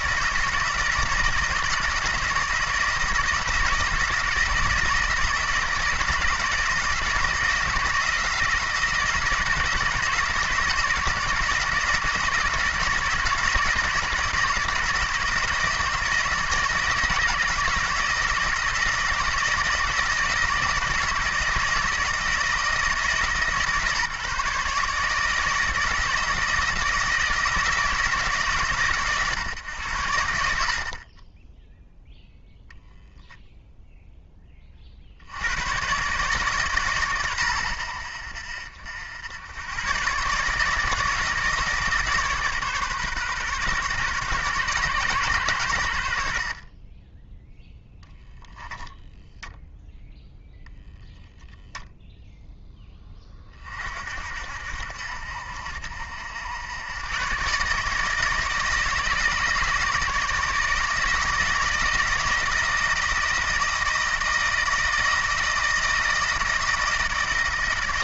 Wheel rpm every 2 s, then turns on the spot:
170, 170, 160, 160, 170, 160, 160, 160, 160, 160, 160, 160, 150, 170, 130, 30, 0, 50, 140, 70, 150, 140, 130, 20, 10, 0, 10, 70, 100, 150, 160, 160, 160, 160.
none